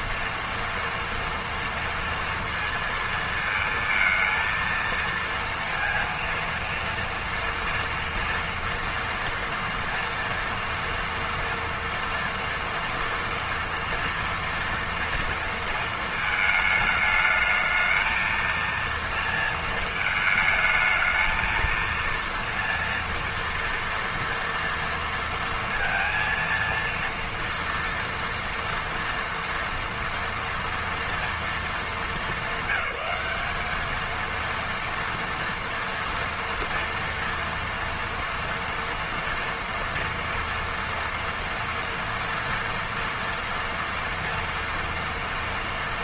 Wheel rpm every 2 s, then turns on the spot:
230, 230, 230, 230, 230, 230, 230, 230, 220, 230, 220, 230, 230, 230, 230, 230, 220, 230, 230, 230, 230, 240, 230.
none